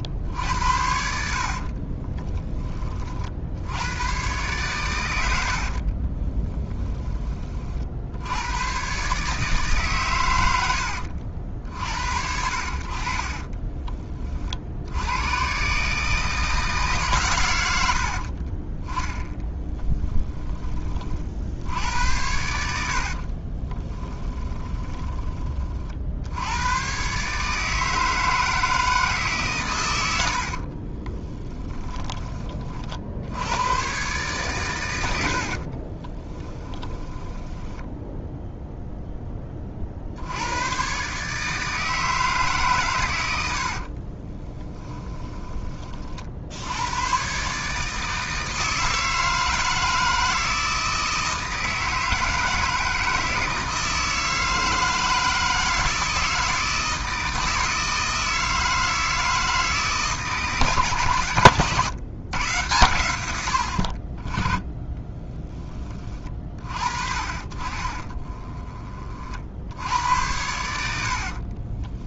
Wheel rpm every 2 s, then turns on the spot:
70, 40, 100, 10, 130, 80, 60, 80, 150, 20, 30, 60, 20, 120, 160, 40, 50, 90, 10, 0, 120, 140, 20, 100, 160, 160, 160, 160, 160, 160, 140, 100, 10, 40, 30, 70.
22-24 30-32 36-38 44-46 70-72